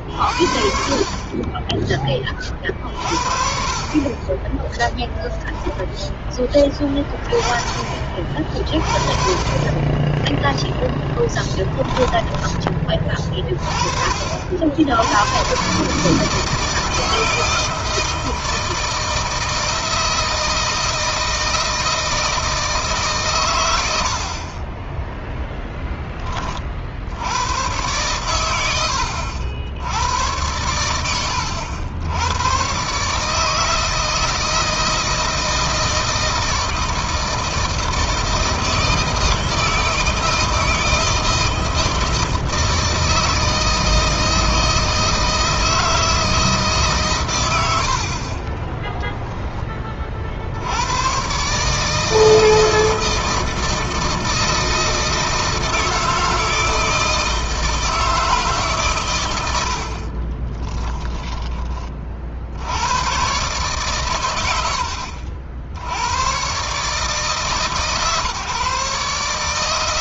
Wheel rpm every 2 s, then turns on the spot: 50, 50, 20, 20, 40, 10, 20, 70, 160, 160, 160, 150, 30, 40, 100, 100, 120, 160, 160, 160, 160, 160, 160, 150, 20, 90, 160, 160, 160, 140, 20, 80, 100, 130, 140.
4-6 10-12 48-50 60-62